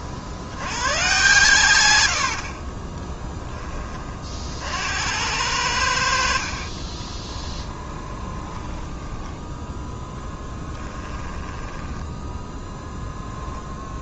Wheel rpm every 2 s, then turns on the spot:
100, 20, 60, 40, 10, 10, 10.
2-4 6-12